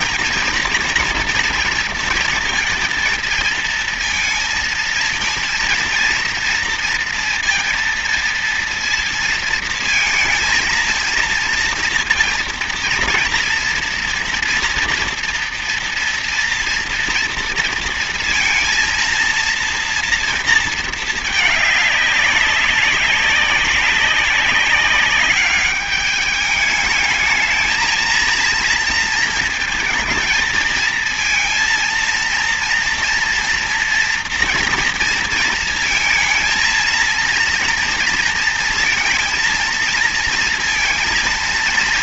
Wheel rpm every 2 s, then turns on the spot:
230, 230, 230, 230, 230, 230, 230, 230, 240, 230, 230, 200, 200, 210, 230, 220, 230, 230, 230, 230, 230.
none